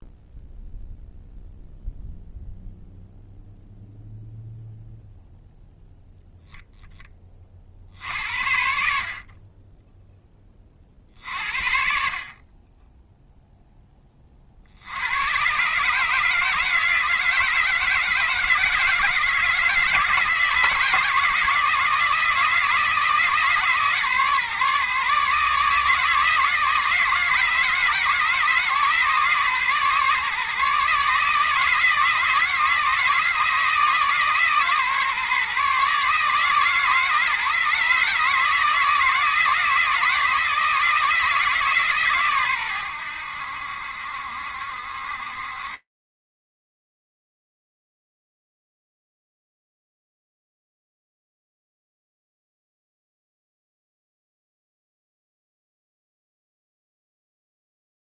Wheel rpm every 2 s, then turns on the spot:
0, 0, 0, 10, 50, 50, 10, 90, 160, 170, 160, 160, 150, 160, 150, 150, 160, 150, 150, 160, 160, 100, 70, 30, 0, 0, 40, 0, 0.
none